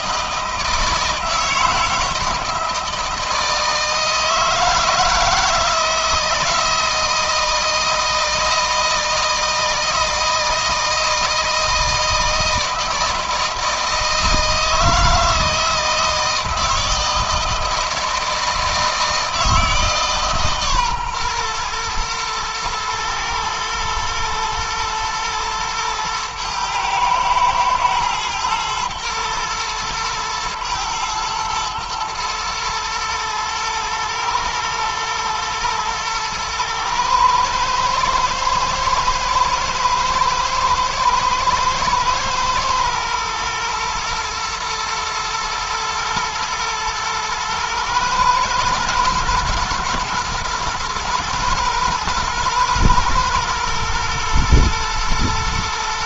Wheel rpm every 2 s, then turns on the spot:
160, 160, 160, 160, 160, 160, 160, 160, 160, 160, 150, 120, 110, 110, 110, 120, 110, 110, 110, 110, 110, 120, 120, 120, 110, 120, 120, 120.
none